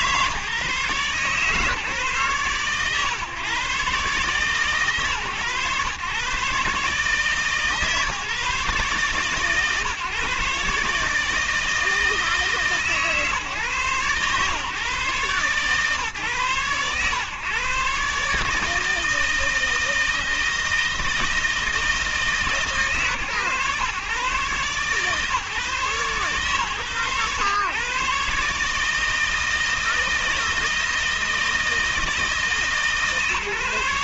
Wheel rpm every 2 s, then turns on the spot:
140, 130, 130, 140, 140, 140, 140, 130, 120, 150, 160, 130, 130, 120, 150, 160, 150.
none